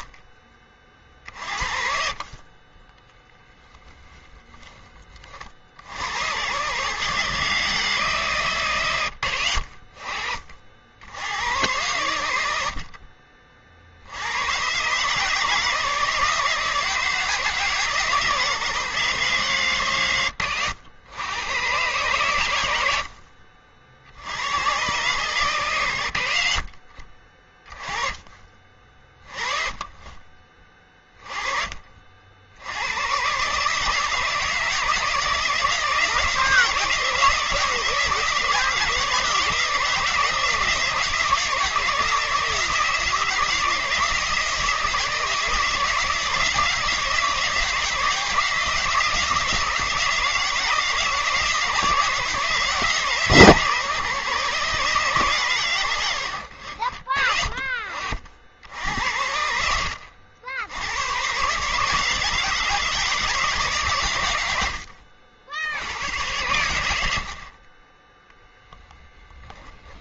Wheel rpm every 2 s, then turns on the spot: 30, 30, 20, 110, 130, 60, 70, 130, 160, 150, 100, 90, 100, 60, 30, 30, 80, 160, 160, 170, 160, 160, 160, 170, 170, 160, 160, 150, 70, 70, 100, 160, 80, 100, 10.
4-6